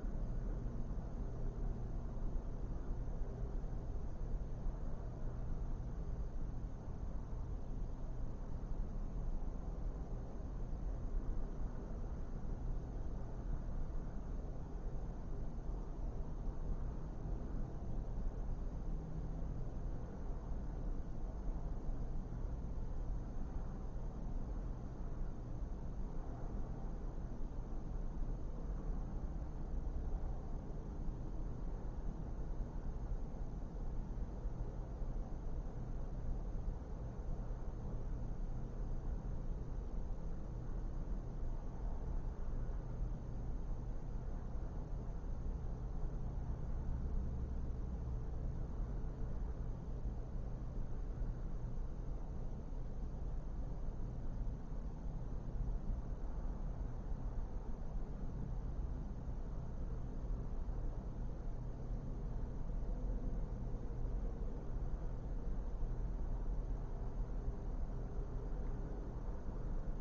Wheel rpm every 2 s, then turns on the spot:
0, 0, 0, 0, 0, 0, 0, 0, 0, 0, 0, 0, 0, 0, 0, 0, 0, 0, 0, 0, 0, 0, 0, 0, 0, 0, 0, 0, 0, 0, 0, 0, 0, 0, 0.
none